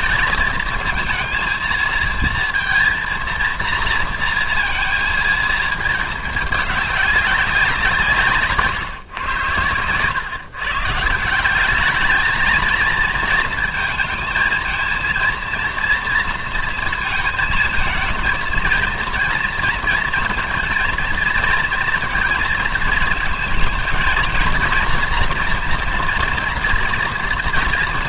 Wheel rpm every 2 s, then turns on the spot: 220, 230, 230, 210, 140, 140, 220, 230, 230, 230, 230, 230, 230, 230.
none